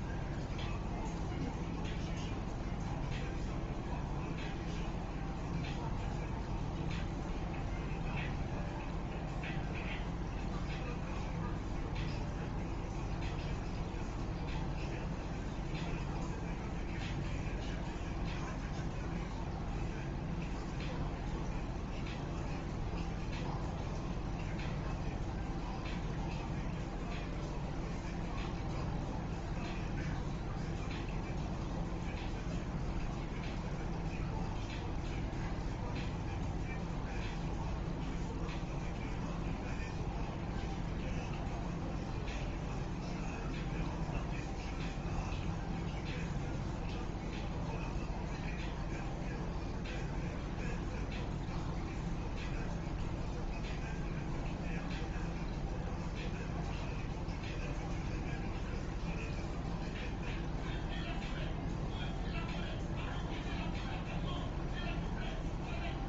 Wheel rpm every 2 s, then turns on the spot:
0, 0, 0, 0, 0, 0, 0, 0, 0, 0, 0, 0, 0, 0, 0, 0, 0, 0, 0, 0, 0, 0, 0, 0, 0, 0, 0, 0, 0, 0, 0, 0, 0.
none